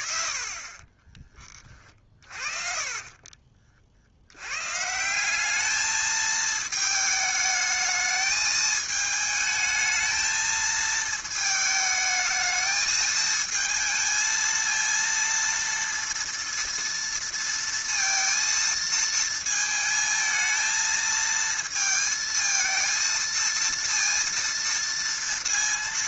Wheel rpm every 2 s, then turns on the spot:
20, 40, 130, 220, 220, 220, 220, 230, 230, 230, 220, 230, 230.
0-4